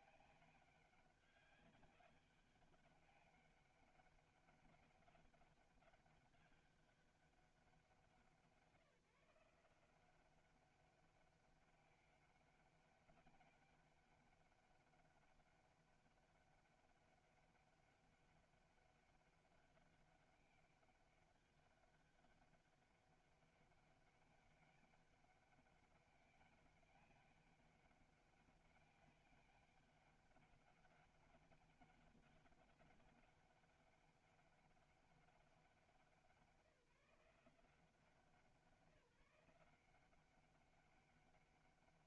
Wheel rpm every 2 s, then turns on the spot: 200, 200, 200, 200, 170, 190, 200, 190, 200, 200, 200, 200, 200, 200, 200, 200, 200, 200, 170, 170, 190.
none